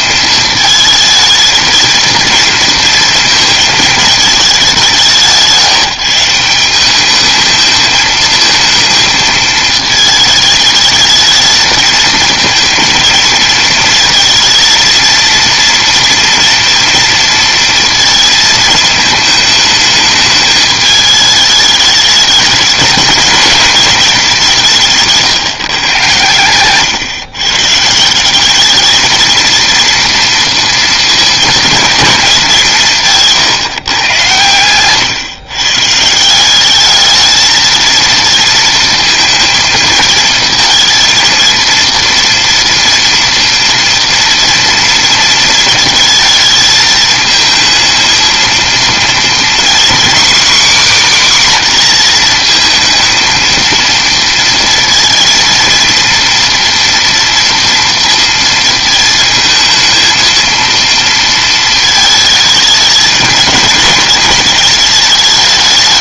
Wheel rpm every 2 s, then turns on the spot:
230, 230, 200, 180, 220, 220, 230, 230, 230, 220, 210, 210, 180, 120, 200, 230, 180, 120, 180, 230, 230, 230, 230, 220, 220, 260, 220, 230, 230, 230, 230, 220, 220.
none